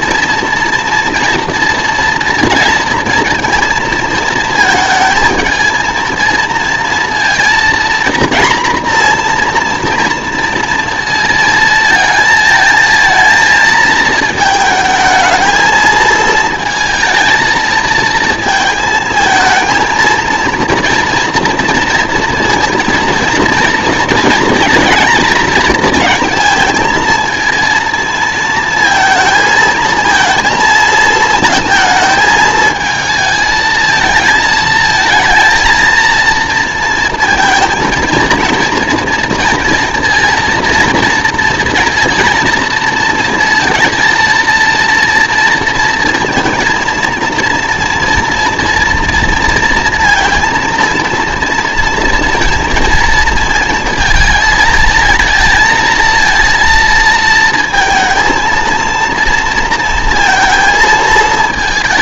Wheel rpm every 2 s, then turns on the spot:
230, 230, 220, 230, 240, 230, 230, 220, 220, 230, 230, 230, 230, 220, 230, 230, 220, 220, 230, 230, 230, 230, 230, 230, 230, 230, 230, 220, 230, 230, 230.
none